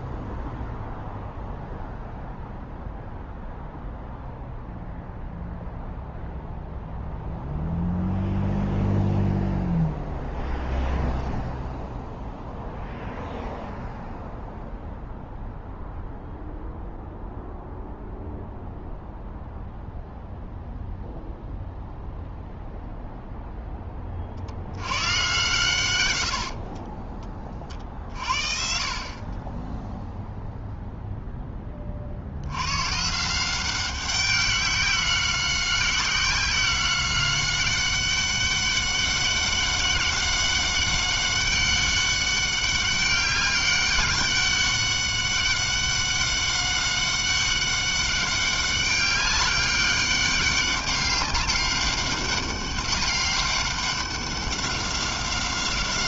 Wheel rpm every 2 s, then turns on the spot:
0, 0, 0, 0, 0, 0, 0, 0, 0, 0, 0, 0, 120, 30, 30, 10, 170, 190, 190, 200, 190, 200, 200, 200, 200, 200, 200, 190.
none